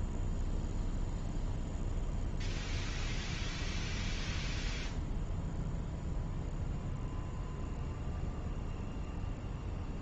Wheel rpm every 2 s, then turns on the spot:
0, 0, 0, 0, 0.
none